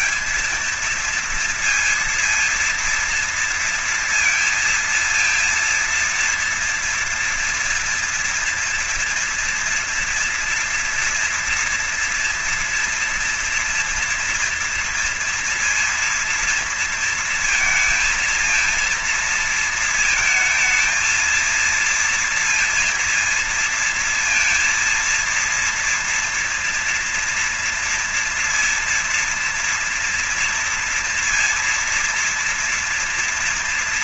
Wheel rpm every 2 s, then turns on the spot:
230, 230, 230, 230, 230, 230, 230, 230, 230, 230, 220, 230, 230, 230, 230, 230, 230.
none